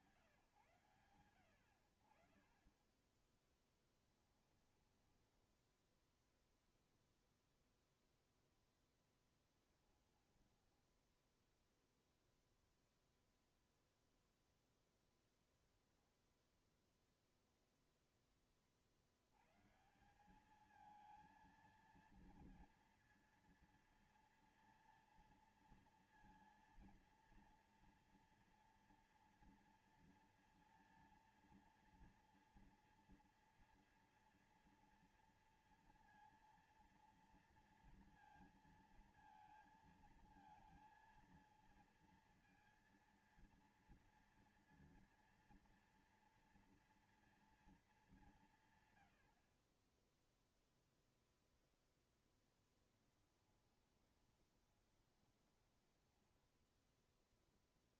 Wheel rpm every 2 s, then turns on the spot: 100, 30, 10, 0, 0, 10, 0, 0, 0, 20, 190, 230, 230, 230, 230, 230, 230, 230, 230, 230, 230, 230, 230, 230, 170, 10, 10, 20, 10.
2-6 10-12 52-58